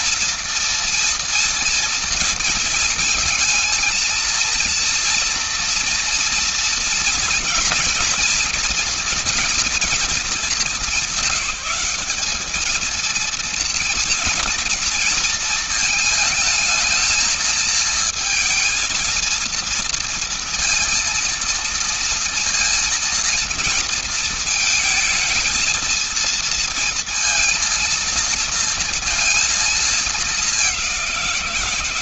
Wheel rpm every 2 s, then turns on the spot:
230, 230, 230, 230, 230, 210, 220, 230, 220, 230, 230, 230, 220, 230, 230, 200.
none